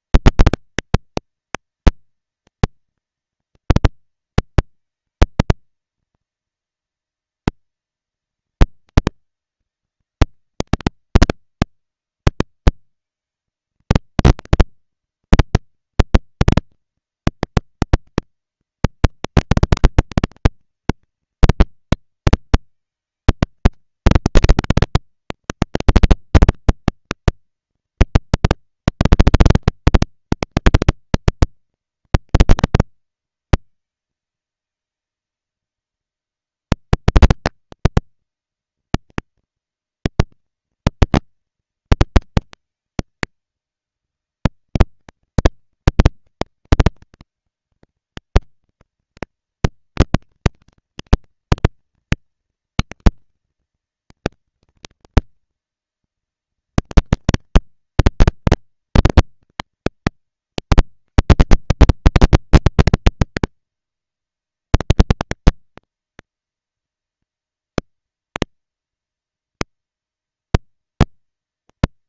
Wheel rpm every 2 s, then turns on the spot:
230, 230, 230, 230, 230, 200, 200, 220, 230, 230, 230, 230, 230, 240, 240, 230, 230, 230, 230, 230, 230, 220, 200, 190, 210, 230, 230, 230, 230, 230, 230, 240, 230, 230, 230, 230.
none